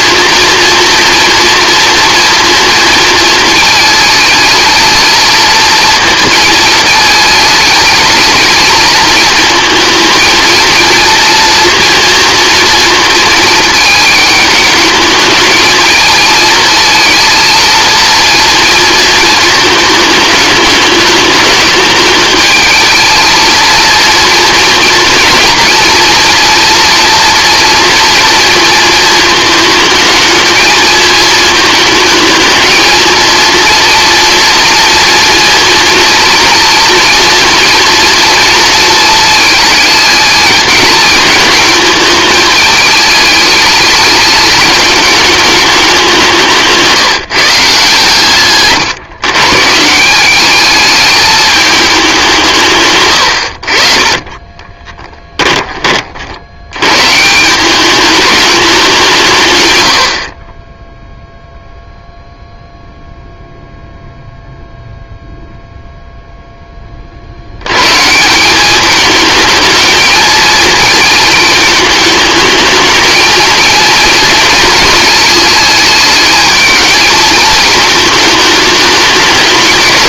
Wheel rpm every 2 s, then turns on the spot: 230, 230, 220, 220, 220, 230, 230, 210, 230, 230, 210, 220, 230, 230, 220, 220, 220, 230, 230, 230, 220, 210, 210, 160, 130, 210, 140, 20, 110, 190, 10, 0, 0, 20, 200, 230, 220, 220, 220, 210.
52-56